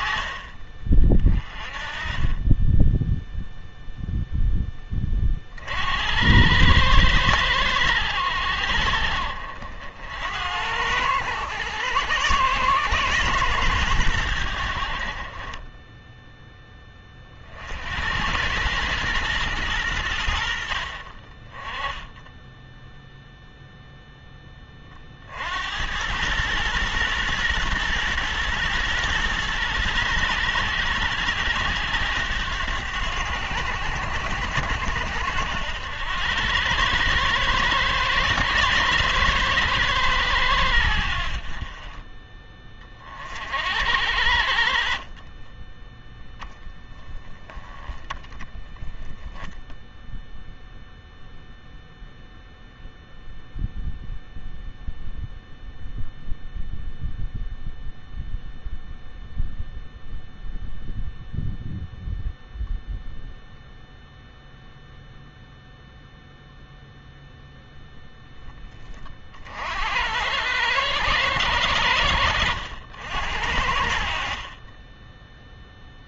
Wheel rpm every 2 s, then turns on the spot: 40, 10, 20, 110, 60, 90, 120, 60, 20, 110, 50, 0, 40, 120, 120, 100, 90, 80, 110, 110, 80, 30, 40, 10, 20, 0, 0, 0, 0, 0, 0, 0, 0, 0, 20, 110, 70, 10.
none